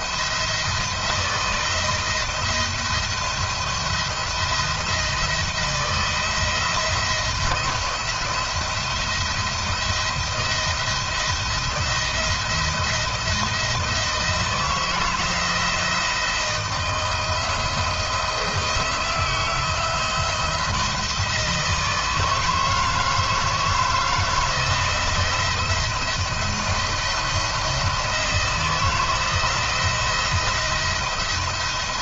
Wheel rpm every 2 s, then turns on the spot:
160, 170, 170, 170, 170, 170, 170, 160, 170, 170, 160, 160, 160, 160, 170, 170.
none